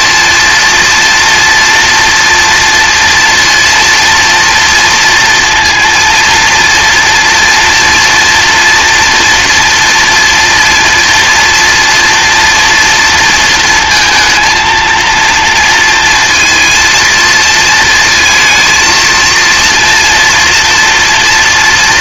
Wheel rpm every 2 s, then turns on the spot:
230, 240, 230, 230, 230, 230, 230, 230, 220, 230, 230.
none